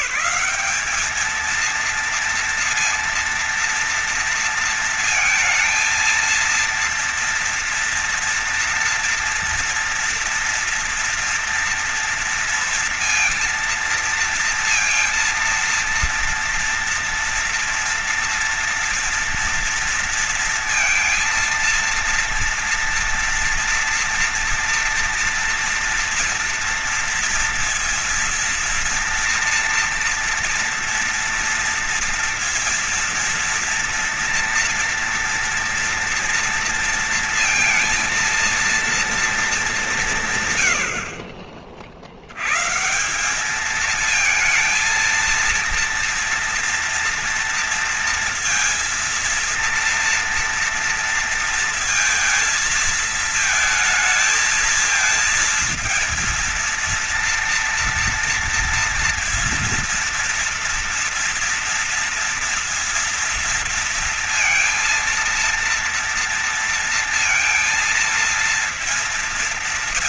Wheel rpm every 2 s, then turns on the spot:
220, 230, 230, 230, 230, 240, 230, 230, 230, 230, 230, 230, 230, 230, 240, 230, 240, 230, 230, 230, 60, 170, 230, 230, 230, 230, 220, 230, 230, 230, 230, 230, 230, 230, 230.
none